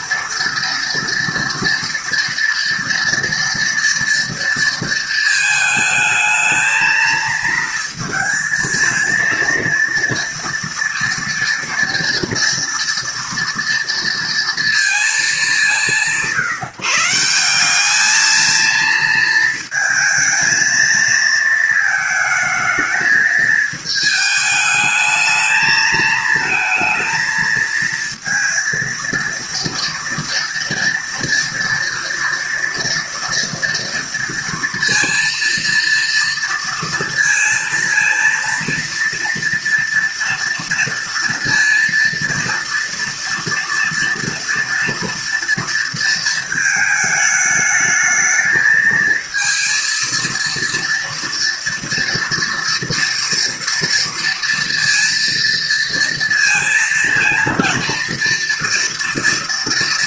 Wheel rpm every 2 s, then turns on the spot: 230, 230, 230, 220, 230, 230, 240, 230, 160, 220, 220, 220, 210, 220, 230, 230, 230, 230, 230, 230, 230, 230, 230, 220, 220, 230, 230, 230, 230, 230.
none